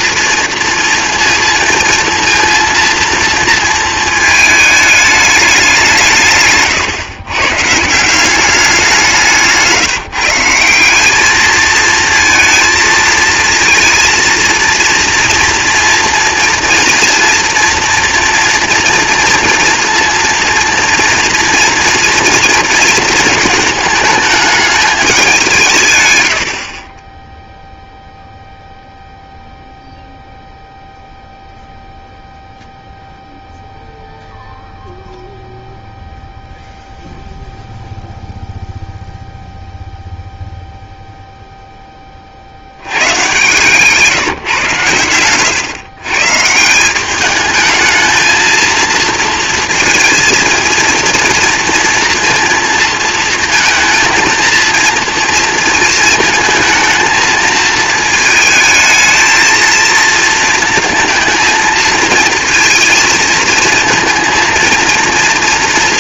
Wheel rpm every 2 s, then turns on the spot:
230, 230, 220, 140, 190, 170, 220, 230, 230, 240, 230, 230, 220, 40, 0, 0, 0, 0, 0, 0, 0, 80, 130, 160, 220, 230, 230, 230, 220, 220, 230, 230, 230.
none